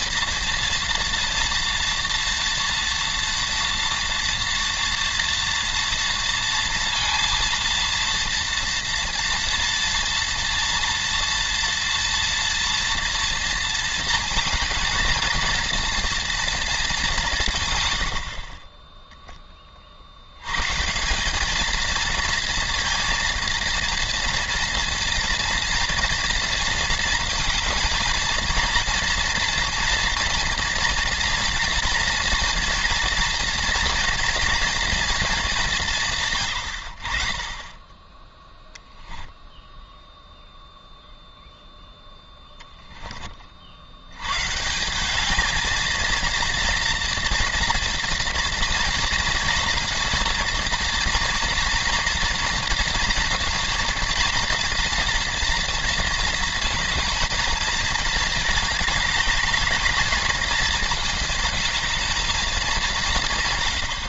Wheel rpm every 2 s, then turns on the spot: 230, 230, 230, 230, 230, 230, 230, 220, 220, 20, 140, 230, 230, 230, 230, 240, 230, 240, 100, 0, 0, 10, 160, 230, 230, 230, 230, 230, 220, 210, 210, 210.
none